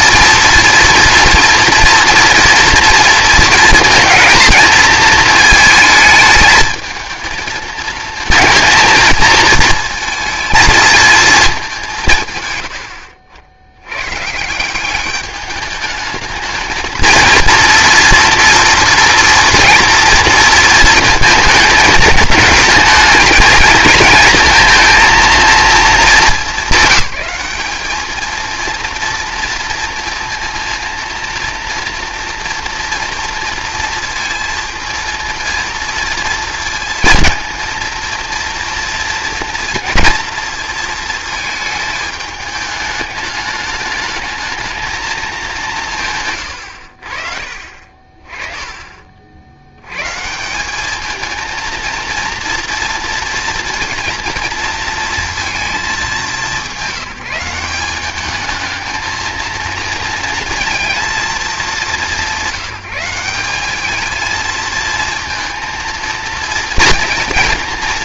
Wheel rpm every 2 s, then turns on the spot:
230, 230, 230, 220, 230, 230, 90, 180, 220, 230, 230, 220, 230, 200, 230, 230, 230, 230, 230, 230, 220, 210, 220, 100, 40, 200, 230, 230, 190, 220, 220, 180, 220, 230.
none